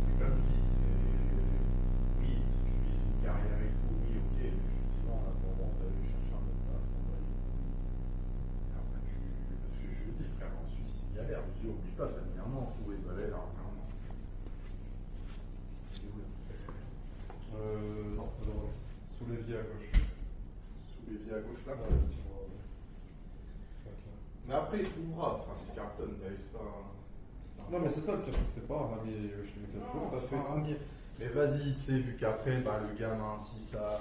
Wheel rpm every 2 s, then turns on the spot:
0, 0, 0, 0, 0, 0, 0, 0, 0, 0, 0, 0, 0, 0, 0, 0, 0.
none